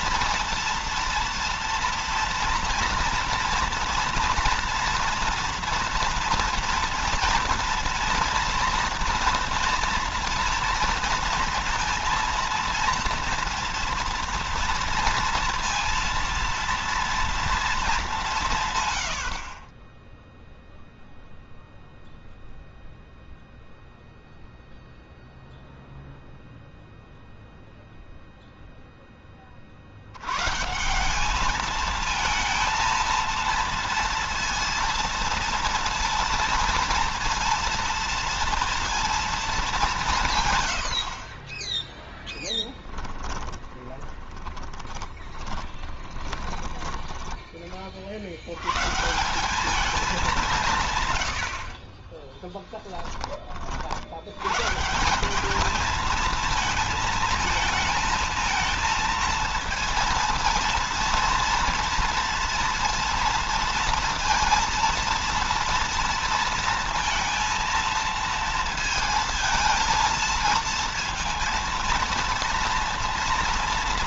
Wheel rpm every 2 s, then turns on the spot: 230, 240, 240, 230, 230, 230, 230, 230, 230, 130, 0, 0, 0, 0, 0, 150, 230, 230, 230, 230, 110, 10, 20, 20, 120, 150, 10, 160, 220, 230, 230, 230, 230, 230, 220, 230, 230.
42-46